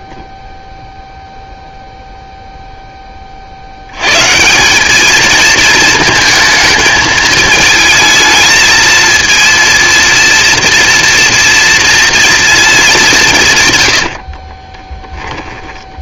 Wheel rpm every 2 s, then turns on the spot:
0, 30, 220, 220, 230, 230, 180, 20.
14-16